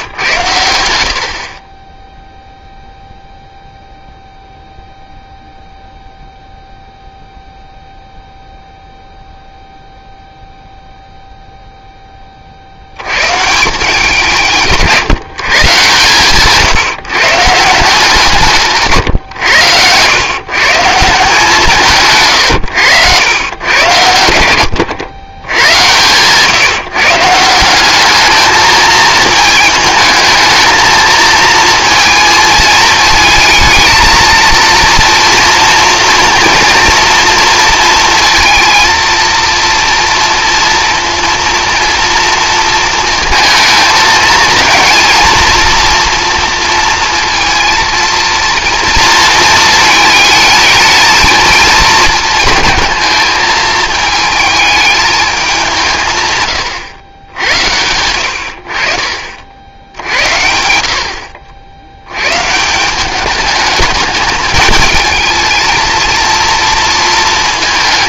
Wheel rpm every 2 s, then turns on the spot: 90, 0, 0, 0, 0, 0, 70, 140, 150, 150, 140, 100, 80, 150, 220, 220, 220, 230, 230, 230, 230, 230, 220, 230, 230, 220, 220, 220, 120, 70, 80, 170, 210, 230.
14-16